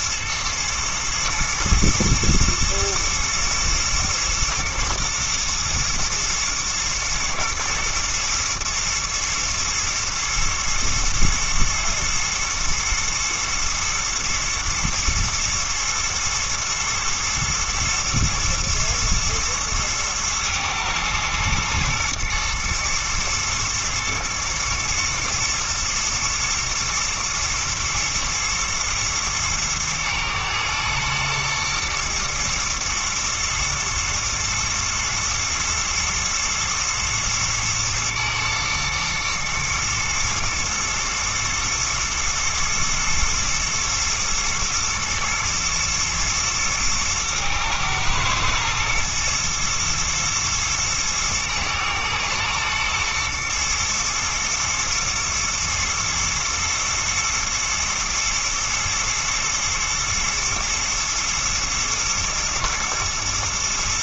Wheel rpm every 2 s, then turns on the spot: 110, 110, 110, 120, 120, 110, 110, 120, 110, 120, 110, 110, 110, 110, 120, 110, 110, 110, 120, 120, 110, 110, 110, 110, 110, 120, 110, 110, 110, 110, 110, 110.
none